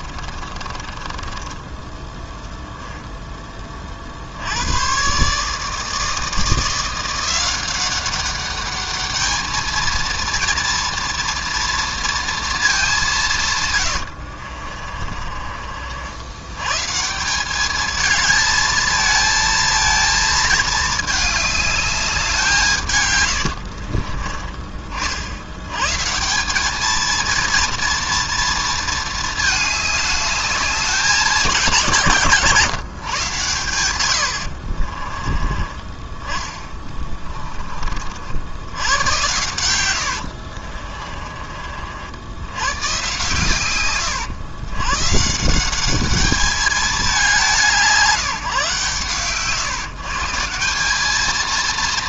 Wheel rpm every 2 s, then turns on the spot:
20, 0, 130, 170, 210, 230, 180, 40, 150, 230, 220, 140, 50, 220, 230, 200, 140, 30, 20, 90, 30, 130, 120, 200, 140, 200.
0-2 14-16 34-38 40-42